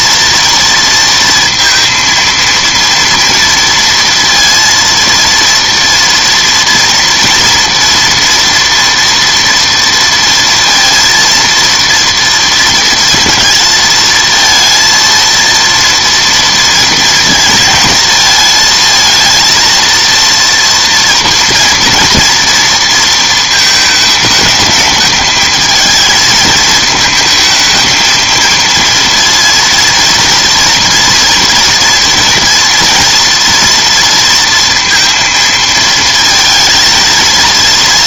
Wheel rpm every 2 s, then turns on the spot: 230, 230, 230, 230, 230, 230, 230, 230, 230, 220, 240, 230, 210, 220, 230, 230, 230, 230, 220.
none